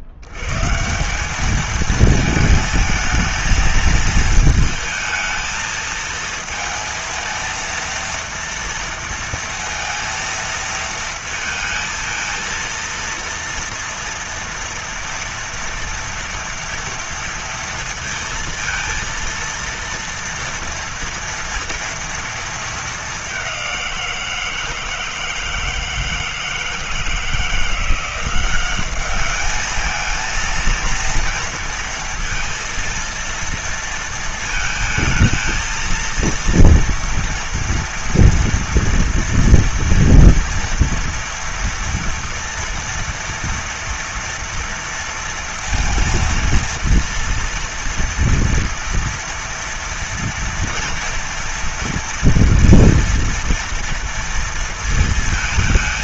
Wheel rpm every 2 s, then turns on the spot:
70, 220, 220, 230, 230, 230, 230, 240, 230, 230, 240, 230, 170, 160, 180, 220, 230, 230, 230, 230, 230, 230, 230, 230, 230, 230, 230, 230.
none